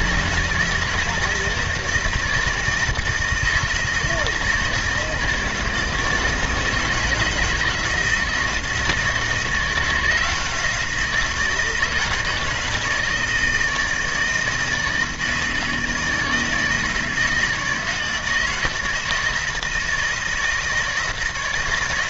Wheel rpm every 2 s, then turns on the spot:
160, 160, 160, 160, 160, 170, 160, 160, 160, 160, 160.
none